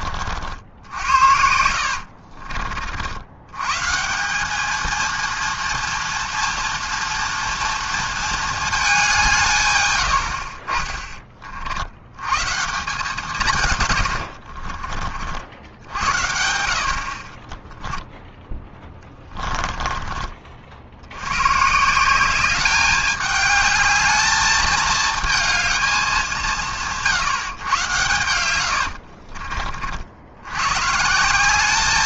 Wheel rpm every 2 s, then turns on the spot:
70, 50, 200, 230, 220, 50, 150, 50, 70, 10, 50, 200, 220, 180, 100, 110.
14-16 18-20 28-30